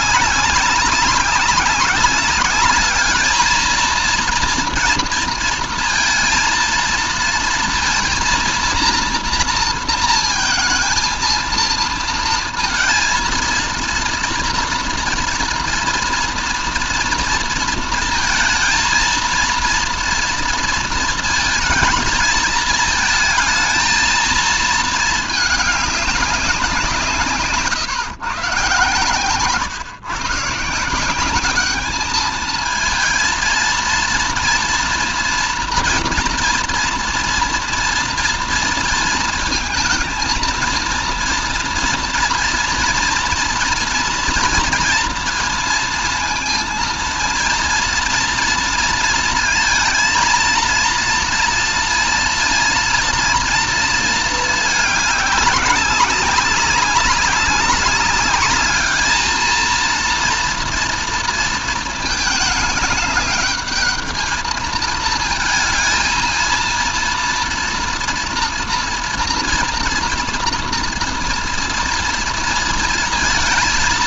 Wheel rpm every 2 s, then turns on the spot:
200, 200, 230, 230, 230, 220, 230, 230, 230, 230, 230, 220, 220, 190, 130, 150, 230, 230, 240, 230, 230, 230, 230, 230, 230, 230, 230, 220, 190, 210, 240, 210, 220, 230, 230, 230, 230.
none